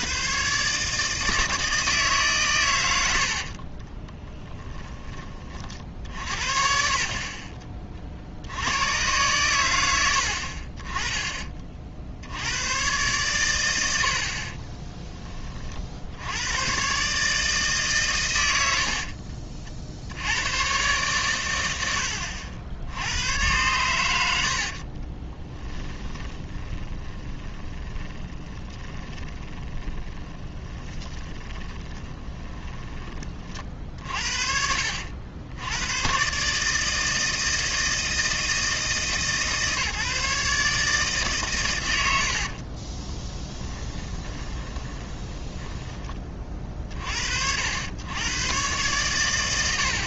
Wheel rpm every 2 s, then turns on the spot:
150, 100, 30, 50, 90, 40, 110, 30, 130, 80, 110, 80, 60, 30, 20, 20, 20, 60, 150, 160, 150, 40, 20, 40, 120.
4-6 14-16 18-20 24-34 42-46